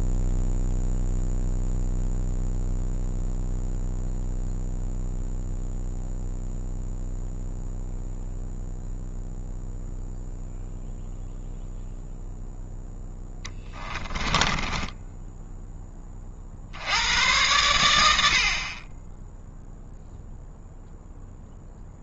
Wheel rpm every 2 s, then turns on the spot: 0, 0, 0, 0, 0, 0, 0, 10, 90, 20, 0.
14-16